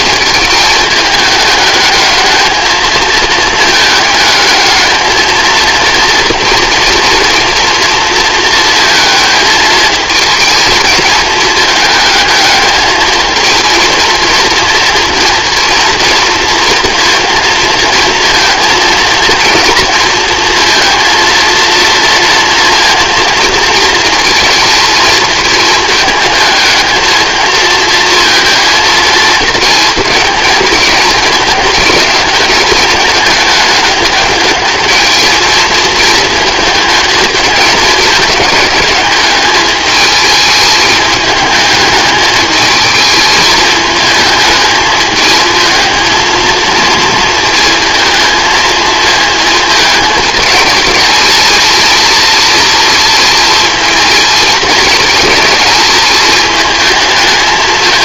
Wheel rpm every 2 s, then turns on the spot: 210, 220, 220, 240, 220, 220, 220, 230, 230, 230, 230, 230, 230, 220, 230, 220, 210, 210, 220, 210, 210, 220, 220, 230, 220, 220, 230, 220, 220.
none